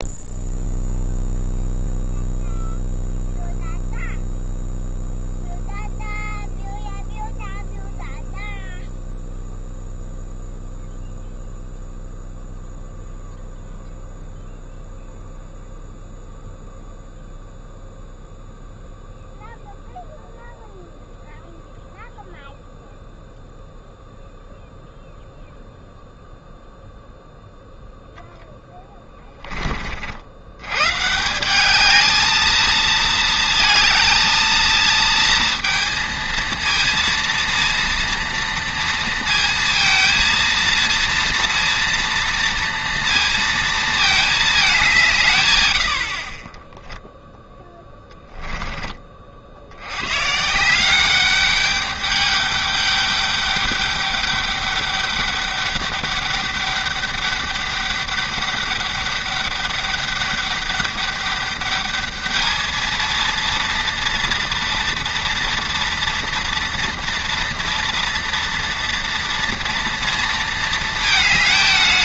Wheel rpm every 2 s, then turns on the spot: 0, 0, 0, 0, 0, 0, 0, 0, 0, 0, 0, 0, 0, 0, 10, 100, 220, 230, 230, 230, 230, 230, 200, 10, 10, 160, 200, 200, 200, 200, 200, 220, 230, 230, 230, 220.
28-30